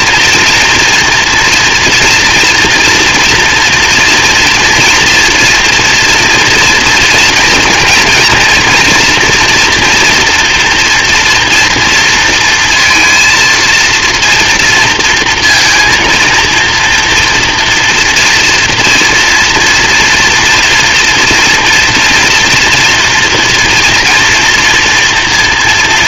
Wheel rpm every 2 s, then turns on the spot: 230, 230, 230, 230, 230, 230, 230, 230, 230, 230, 230, 230, 240.
none